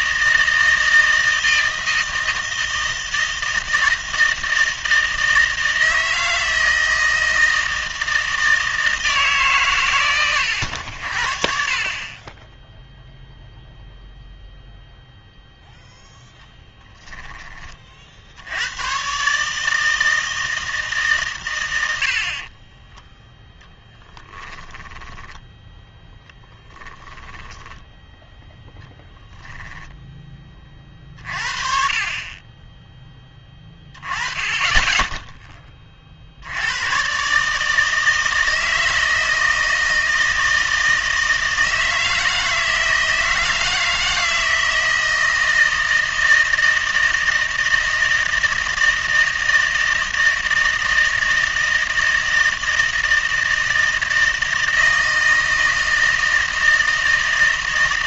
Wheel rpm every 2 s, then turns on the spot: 160, 160, 160, 160, 160, 80, 0, 0, 10, 100, 160, 20, 10, 10, 0, 30, 20, 20, 90, 160, 160, 160, 160, 160, 160, 160, 160, 160, 160.
22-28